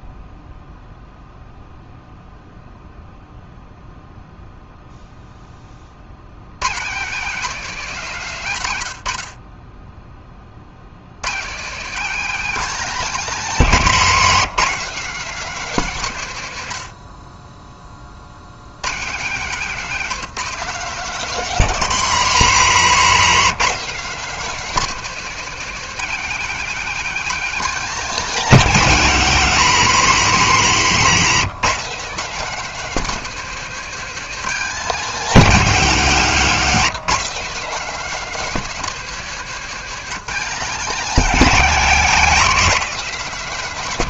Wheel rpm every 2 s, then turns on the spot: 0, 0, 0, 120, 150, 50, 240, 220, 130, 90, 220, 200, 230, 230, 230, 180, 220, 220, 190, 230, 210, 220.
none